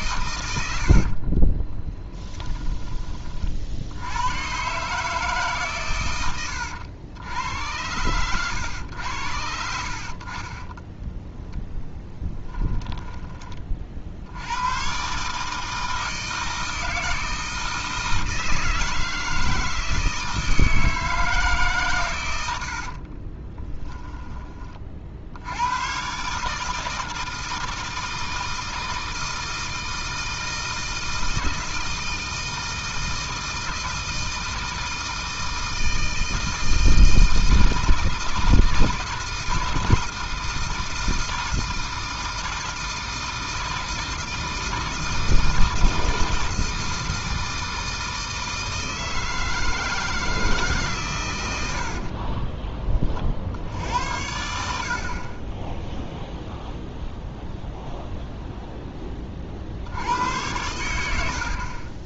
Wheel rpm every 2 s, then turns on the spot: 90, 20, 130, 100, 90, 20, 10, 100, 160, 160, 160, 80, 30, 160, 160, 160, 160, 160, 160, 160, 160, 160, 160, 160, 160, 150, 20, 70, 0, 0, 90.
0-4 10-14